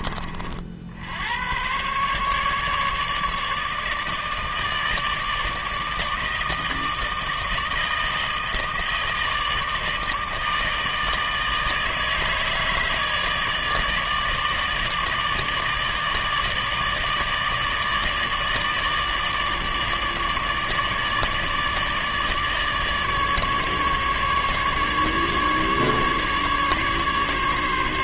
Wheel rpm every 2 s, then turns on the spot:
50, 150, 160, 160, 160, 160, 150, 150, 150, 150, 150, 150, 150, 140.
none